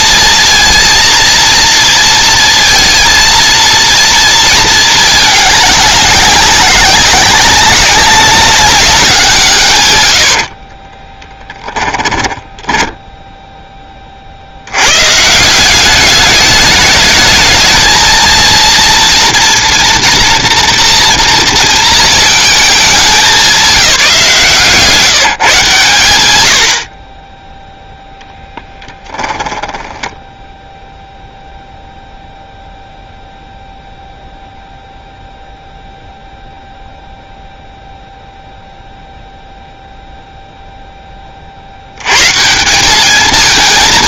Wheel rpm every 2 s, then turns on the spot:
230, 230, 200, 200, 120, 10, 10, 160, 220, 240, 230, 180, 150, 10, 10, 0, 0, 0, 0, 0, 0, 180.
10-12